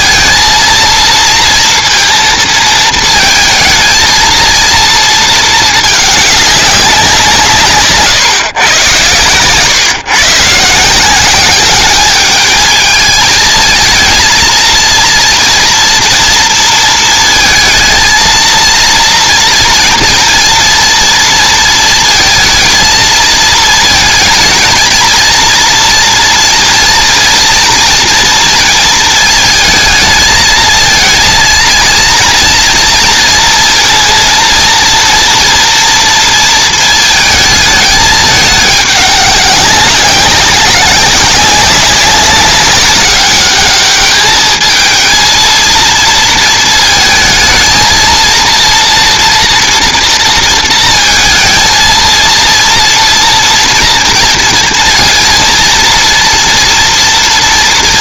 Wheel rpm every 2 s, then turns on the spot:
230, 230, 220, 190, 110, 170, 220, 230, 230, 230, 230, 220, 220, 230, 230, 230, 240, 230, 220, 200, 190, 200, 220, 220, 230, 230, 230, 230, 230.
none